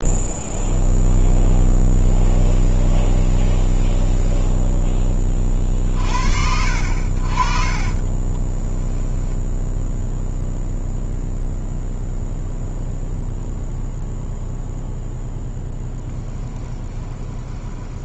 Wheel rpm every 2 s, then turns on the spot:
0, 0, 0, 60, 10, 0, 0, 0, 20.
8-10 16-18